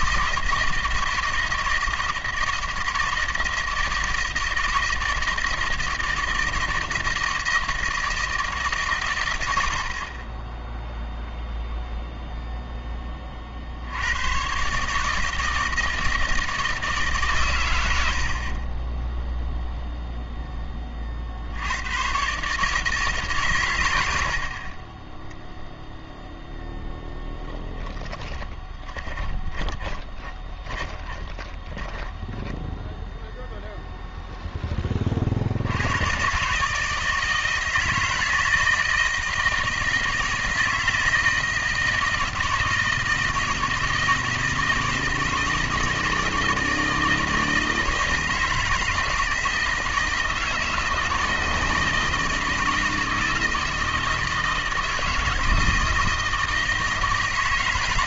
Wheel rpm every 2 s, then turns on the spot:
160, 160, 160, 160, 140, 10, 10, 140, 160, 30, 20, 150, 30, 0, 30, 20, 10, 20, 150, 160, 160, 160, 160, 160, 160, 160, 160, 160, 160.
28-32